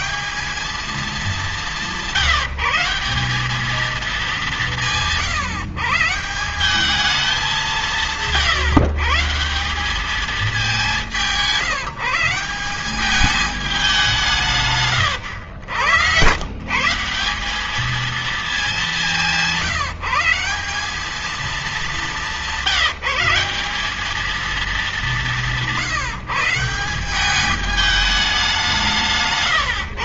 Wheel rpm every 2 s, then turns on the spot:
200, 190, 160, 190, 130, 180, 200, 100, 170, 190, 200, 190, 200, 180, 150.
none